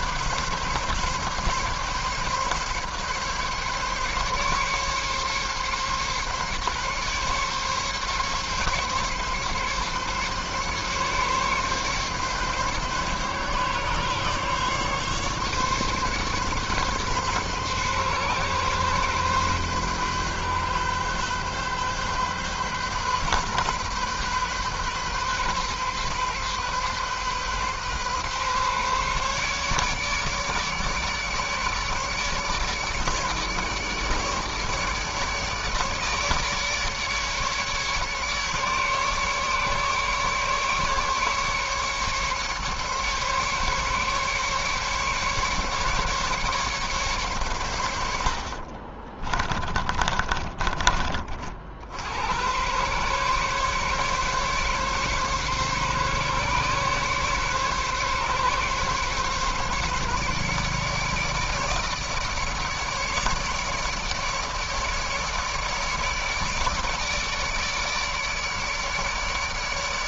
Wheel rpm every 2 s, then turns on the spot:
140, 140, 140, 140, 140, 140, 140, 140, 140, 130, 130, 130, 130, 140, 140, 150, 150, 150, 150, 150, 140, 140, 140, 140, 60, 30, 100, 140, 140, 140, 150, 150, 150, 150, 150.
48-52